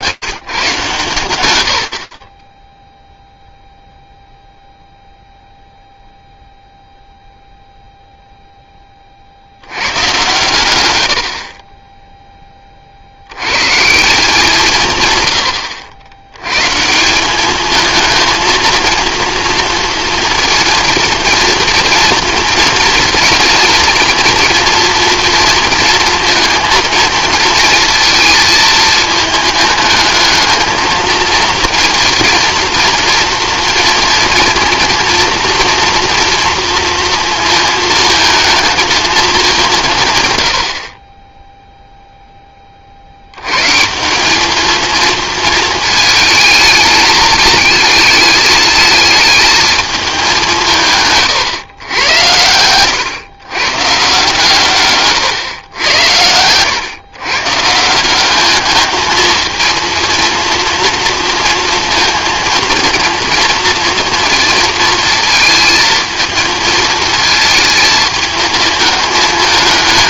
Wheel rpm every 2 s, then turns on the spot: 140, 30, 0, 0, 0, 120, 20, 170, 110, 230, 230, 230, 230, 230, 220, 220, 230, 230, 240, 220, 100, 10, 200, 220, 210, 190, 100, 150, 100, 200, 230, 230, 230, 220, 220.
none